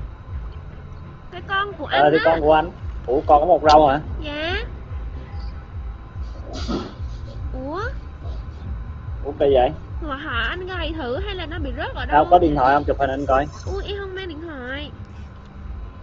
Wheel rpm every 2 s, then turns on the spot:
0, 0, 0, 0, 10, 10, 0, 0.
none